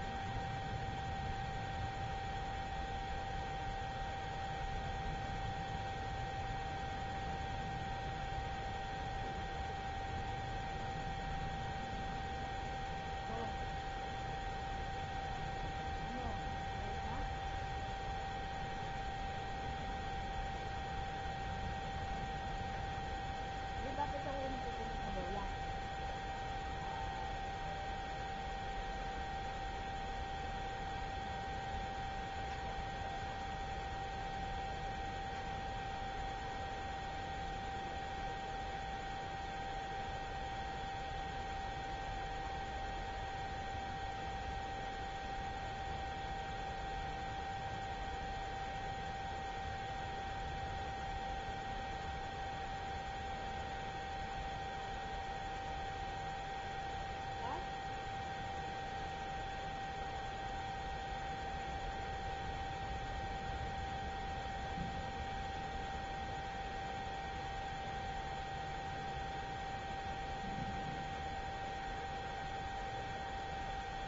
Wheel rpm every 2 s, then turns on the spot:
0, 0, 0, 0, 0, 0, 0, 0, 0, 0, 0, 0, 0, 0, 0, 0, 0, 0, 0, 0, 0, 0, 0, 0, 0, 0, 0, 0, 0, 0, 0, 0, 0, 0, 0, 0, 0.
none